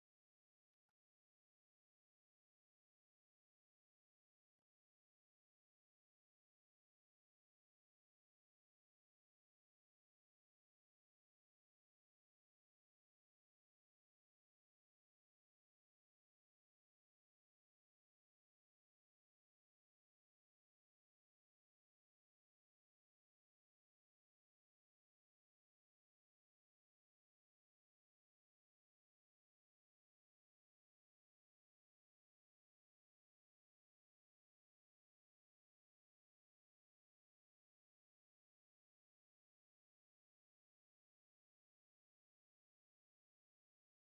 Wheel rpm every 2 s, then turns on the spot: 0, 0, 0, 0, 0, 0, 0, 0, 0, 0, 0, 0, 0, 0, 0, 0, 0, 0, 0, 0, 0, 0.
none